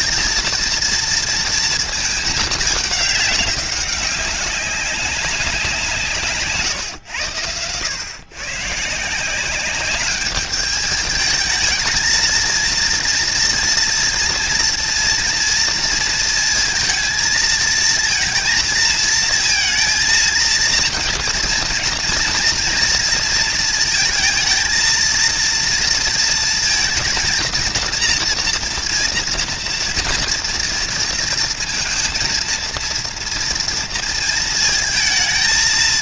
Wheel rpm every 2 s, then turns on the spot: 230, 210, 200, 140, 140, 210, 230, 240, 230, 230, 230, 230, 220, 230, 230, 230, 230, 220.
none